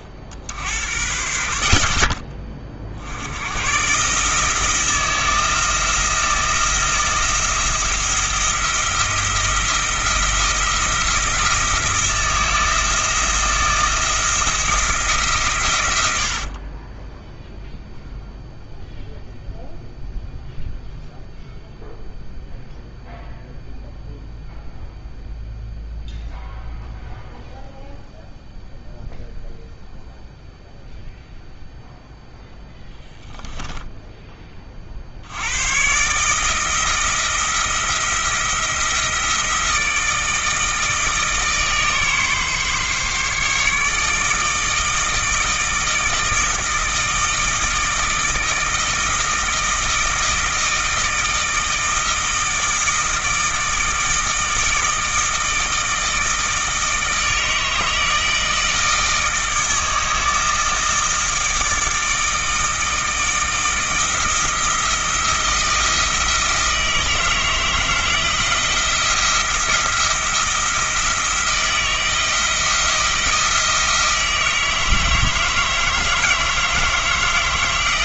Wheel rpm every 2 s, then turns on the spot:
70, 50, 160, 170, 170, 170, 160, 170, 40, 0, 0, 0, 0, 0, 0, 0, 0, 20, 160, 170, 160, 140, 160, 160, 160, 160, 160, 160, 160, 160, 160, 160, 170, 160, 170, 170, 160, 160, 160.
16-18